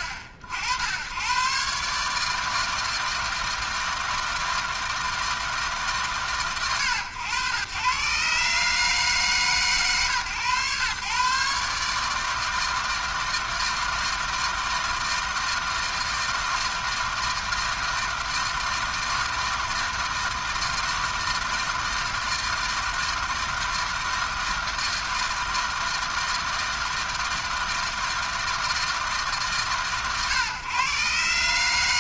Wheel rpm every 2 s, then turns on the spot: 80, 160, 160, 100, 140, 120, 160, 160, 160, 160, 160, 160, 160, 160, 160, 130.
none